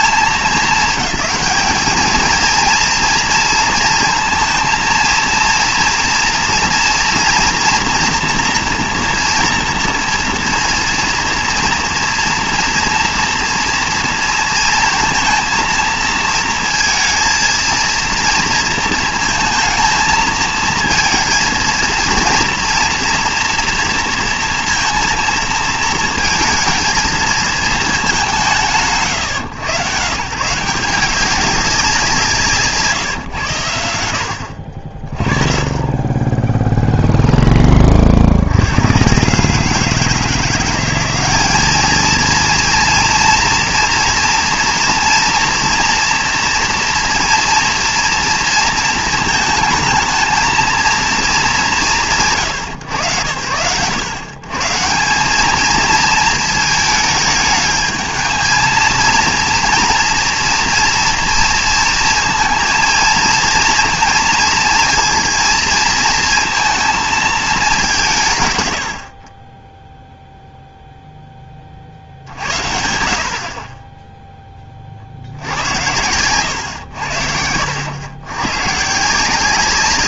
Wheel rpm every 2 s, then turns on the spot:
220, 230, 230, 240, 230, 230, 230, 230, 230, 230, 230, 230, 230, 220, 130, 170, 150, 60, 10, 80, 180, 230, 240, 230, 230, 220, 130, 120, 220, 220, 230, 230, 230, 230, 120, 0, 80, 20, 100, 110.
none